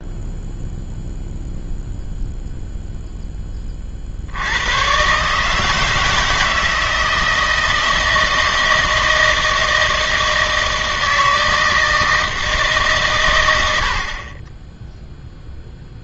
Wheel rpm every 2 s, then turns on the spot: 0, 0, 100, 160, 160, 160, 150, 10.
none